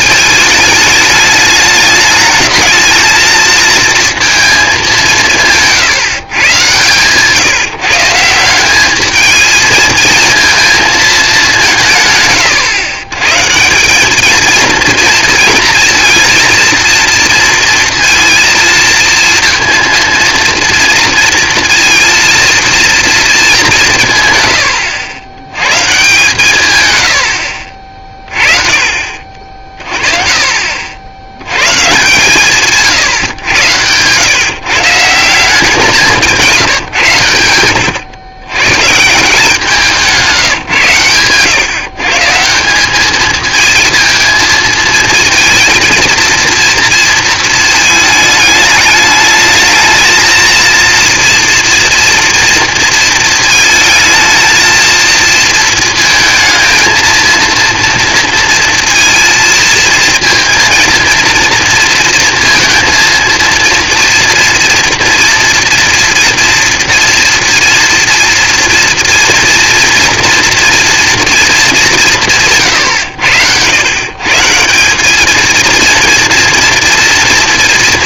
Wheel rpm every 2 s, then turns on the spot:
210, 220, 210, 130, 190, 230, 130, 230, 230, 230, 230, 230, 100, 140, 30, 40, 150, 140, 160, 130, 140, 180, 220, 230, 210, 230, 230, 230, 220, 230, 230, 230, 230, 230, 230, 230, 130, 170, 230.
none